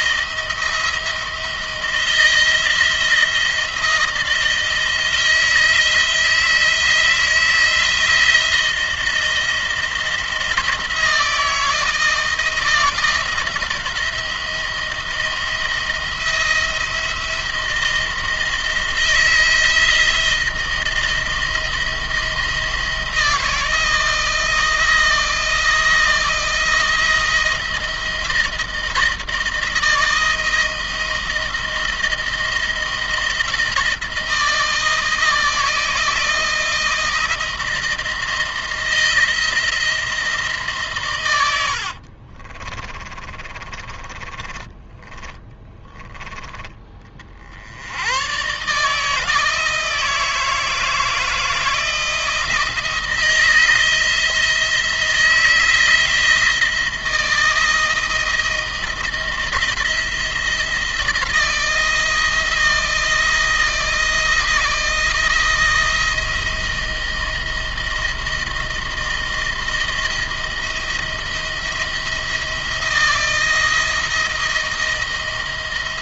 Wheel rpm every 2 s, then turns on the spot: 170, 160, 160, 160, 170, 160, 160, 170, 170, 160, 170, 170, 160, 170, 160, 160, 170, 160, 160, 160, 150, 30, 20, 30, 140, 160, 170, 170, 170, 170, 170, 170, 160, 170, 170, 170, 170, 170.
42-46